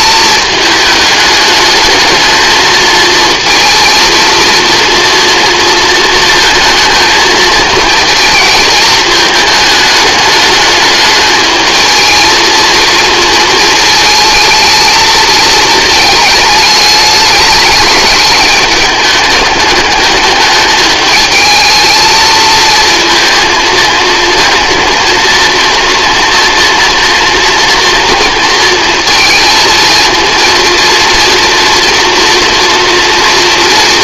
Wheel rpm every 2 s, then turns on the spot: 210, 230, 230, 230, 210, 220, 220, 220, 210, 210, 220, 220, 240, 230, 230, 240, 230.
none